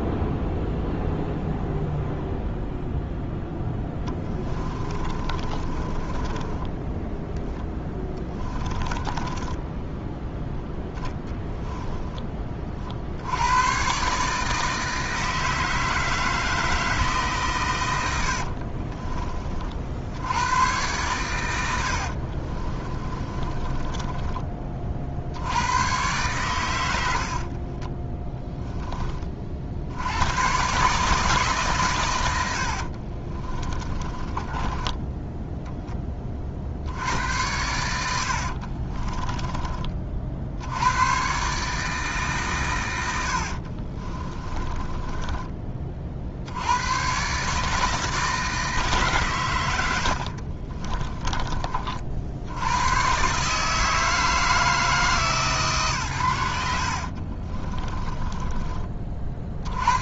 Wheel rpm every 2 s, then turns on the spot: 0, 0, 20, 10, 10, 0, 40, 160, 160, 50, 100, 30, 30, 110, 10, 130, 70, 20, 50, 50, 80, 110, 20, 90, 160, 40, 100, 160, 80, 20.
4-10 18-20 22-24 32-36 38-40 44-46 50-52